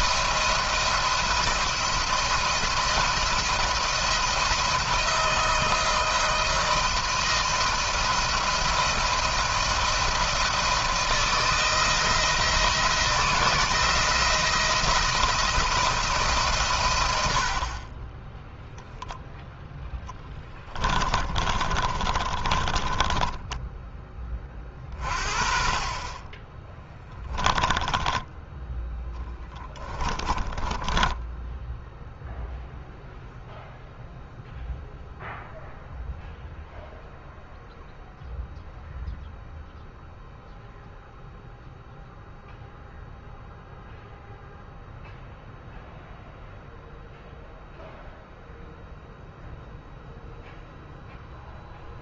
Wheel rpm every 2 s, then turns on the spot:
170, 170, 170, 160, 170, 160, 160, 160, 110, 10, 20, 20, 30, 10, 10, 20, 0, 0, 0, 0, 0, 0, 0, 0, 0, 0.
20-24 26-28 30-32